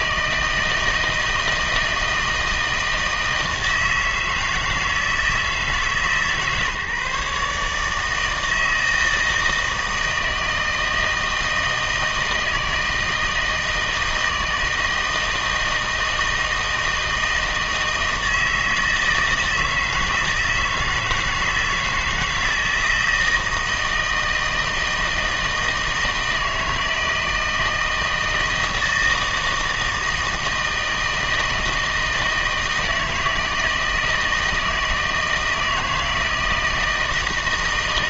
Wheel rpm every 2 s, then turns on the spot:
160, 160, 160, 150, 160, 160, 160, 160, 160, 160, 160, 160, 160, 160, 160, 160, 160, 160, 160.
none